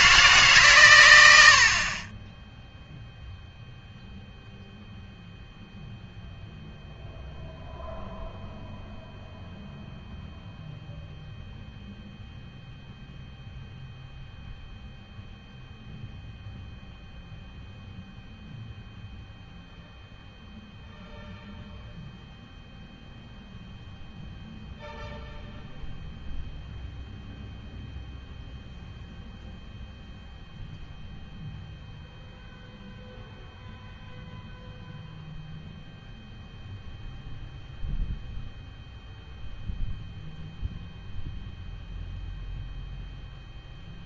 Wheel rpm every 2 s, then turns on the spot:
140, 0, 0, 0, 0, 0, 0, 0, 0, 0, 0, 0, 0, 0, 0, 0, 0, 0, 0, 0, 0, 0.
none